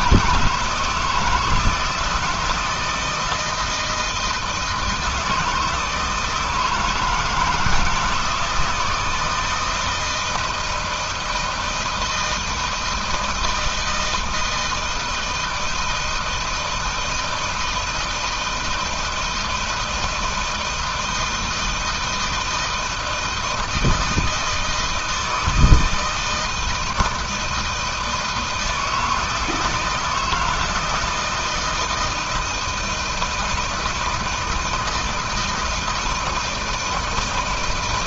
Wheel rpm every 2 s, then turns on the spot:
160, 160, 160, 160, 160, 160, 160, 160, 160, 160, 160, 160, 160, 160, 160, 160, 170, 170, 160.
none